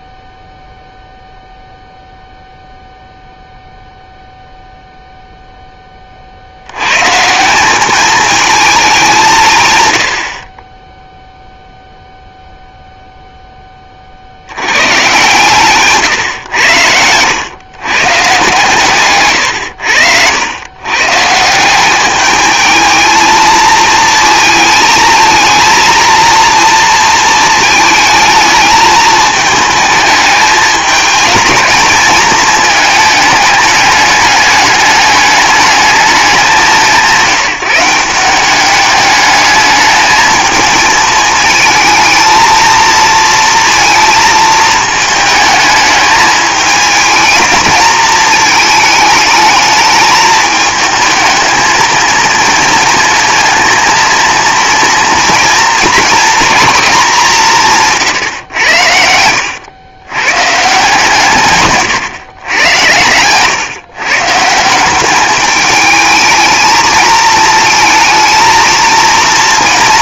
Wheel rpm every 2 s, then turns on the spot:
0, 0, 0, 100, 210, 20, 0, 110, 100, 130, 110, 220, 230, 230, 220, 220, 220, 210, 180, 200, 220, 230, 220, 220, 220, 220, 230, 230, 230, 90, 150, 110, 180, 220, 230.
none